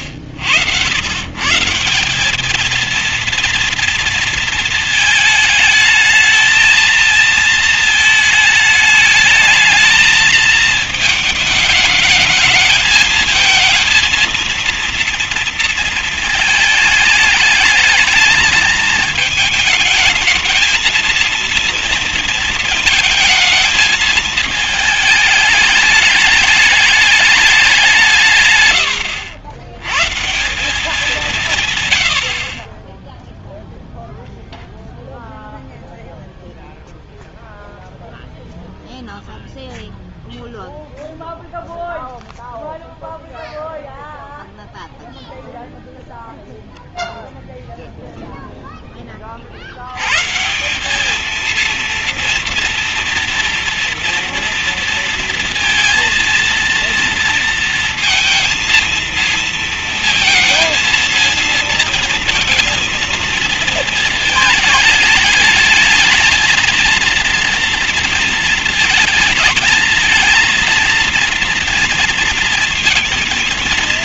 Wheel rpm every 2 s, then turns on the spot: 80, 230, 220, 220, 220, 220, 220, 230, 220, 220, 220, 220, 220, 210, 150, 170, 30, 0, 0, 0, 0, 0, 0, 0, 0, 160, 230, 230, 230, 230, 230, 230, 220, 230, 230, 230, 240.
none